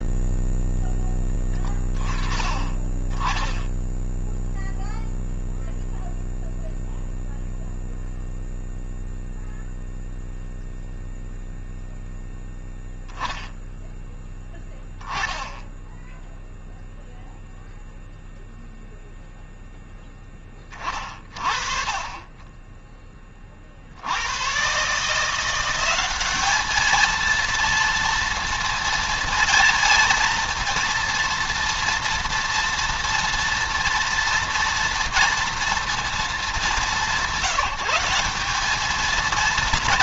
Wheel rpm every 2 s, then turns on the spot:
0, 20, 0, 0, 0, 0, 0, 10, 0, 0, 20, 20, 120, 210, 230, 230, 230, 230, 200, 210.
none